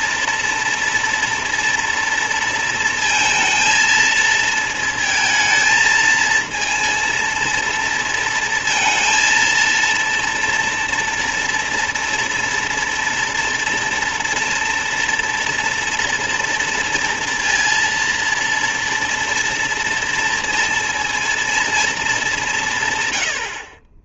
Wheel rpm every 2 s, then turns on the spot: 230, 230, 220, 230, 230, 230, 230, 230, 230, 230, 230, 150.
none